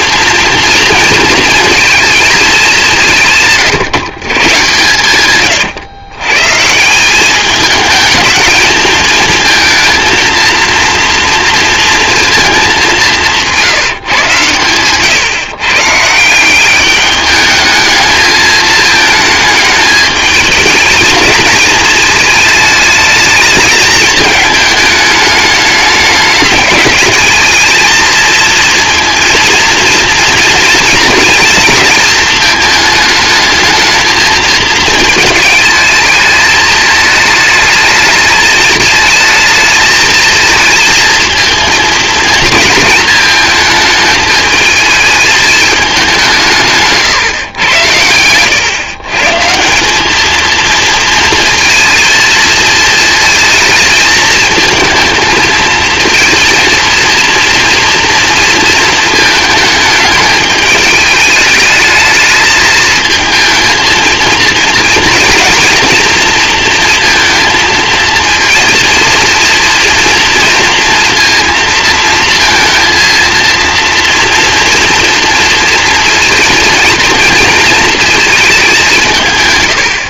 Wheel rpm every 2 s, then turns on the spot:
240, 200, 130, 150, 220, 230, 210, 130, 190, 220, 220, 220, 210, 200, 220, 230, 220, 220, 220, 210, 230, 220, 220, 160, 120, 230, 220, 220, 230, 230, 210, 210, 230, 230, 230, 230, 230, 230, 240, 210.
none